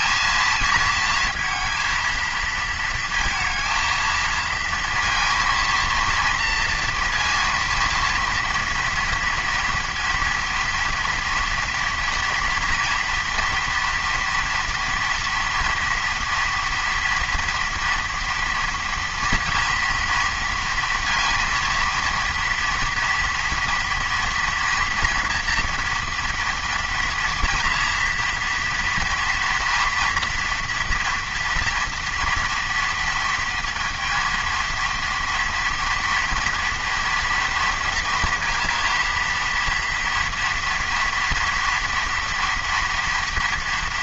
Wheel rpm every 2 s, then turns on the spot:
230, 230, 230, 230, 230, 230, 230, 240, 240, 230, 230, 230, 230, 240, 240, 230, 230, 230, 240, 230, 230, 230.
none